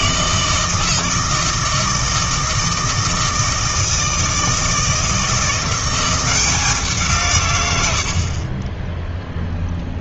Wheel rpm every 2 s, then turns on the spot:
160, 160, 160, 170, 20.
none